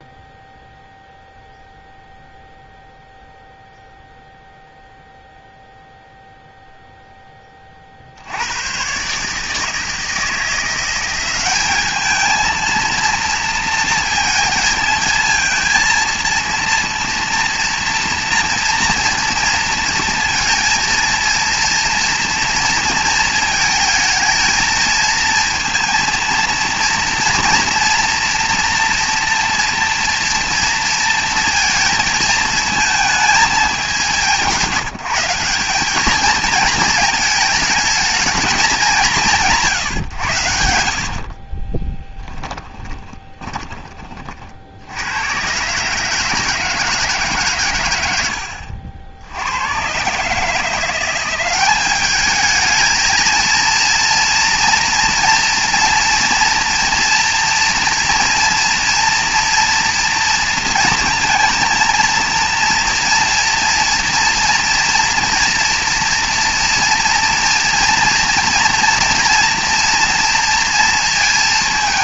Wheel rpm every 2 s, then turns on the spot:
0, 0, 0, 0, 120, 170, 220, 220, 230, 230, 230, 230, 230, 230, 230, 230, 220, 170, 220, 210, 70, 10, 60, 160, 80, 160, 220, 230, 230, 230, 230, 230, 240, 230, 230, 230.
42-44